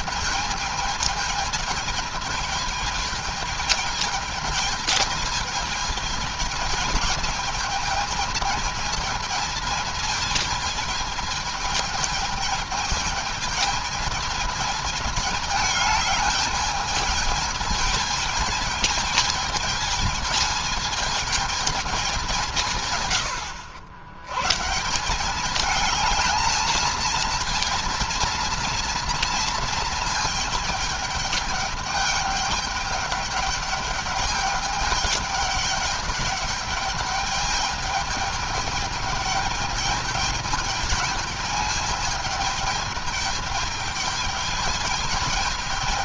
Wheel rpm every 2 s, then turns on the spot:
210, 220, 220, 220, 220, 220, 210, 210, 210, 220, 220, 120, 170, 220, 230, 220, 210, 210, 210, 210, 210, 210, 220.
none